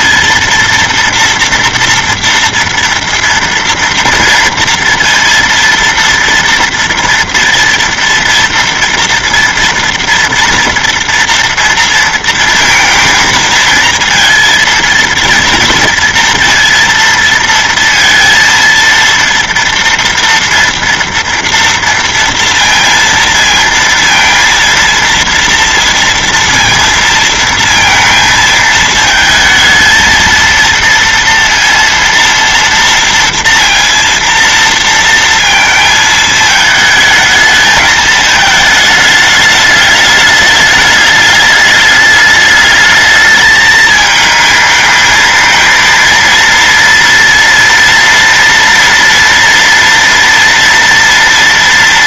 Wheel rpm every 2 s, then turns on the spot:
230, 240, 230, 230, 230, 230, 230, 230, 230, 230, 230, 230, 230, 230, 220, 230, 230, 230, 220, 220, 210, 210, 220, 230, 230, 230.
none